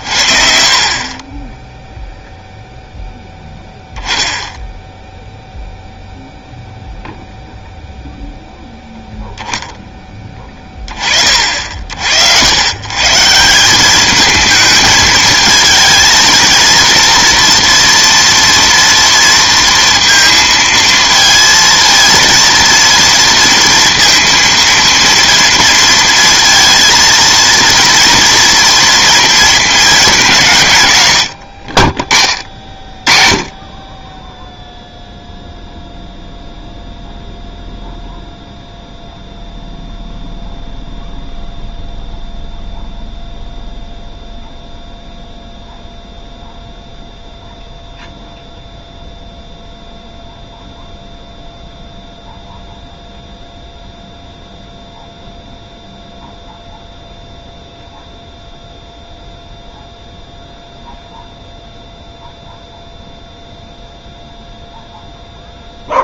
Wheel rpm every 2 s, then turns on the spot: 50, 0, 10, 0, 0, 20, 100, 220, 230, 230, 230, 230, 230, 230, 230, 160, 30, 0, 0, 0, 0, 0, 0, 0, 0, 0, 0, 0, 0, 0, 0, 0, 0.
none